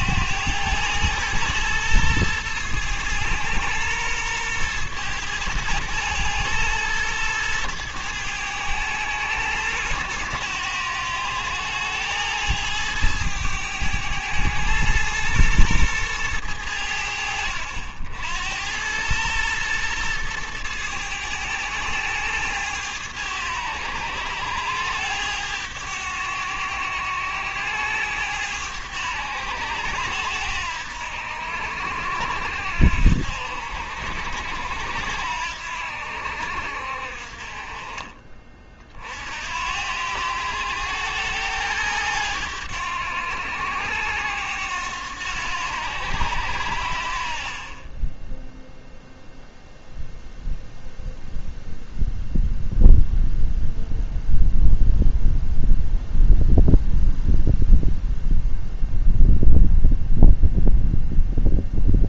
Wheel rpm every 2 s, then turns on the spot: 110, 110, 110, 110, 110, 100, 110, 110, 90, 90, 110, 100, 100, 90, 100, 80, 70, 80, 60, 40, 100, 90, 90, 70, 0, 0, 0, 0, 0, 0, 0.
none